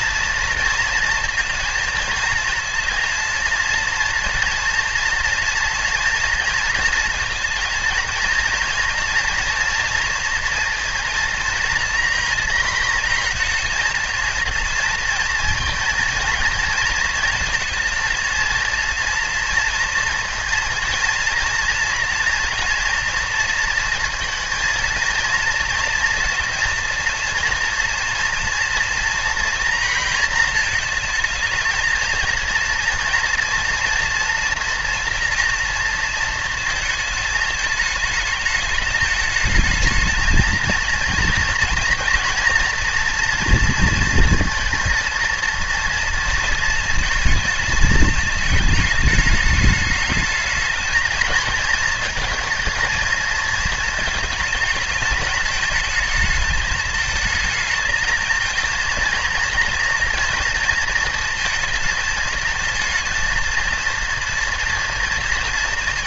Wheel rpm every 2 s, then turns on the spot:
230, 230, 230, 230, 230, 230, 230, 230, 230, 230, 230, 230, 230, 230, 230, 230, 230, 240, 230, 220, 230, 230, 230, 230, 210, 210, 220, 220, 220, 220, 230, 230, 230.
none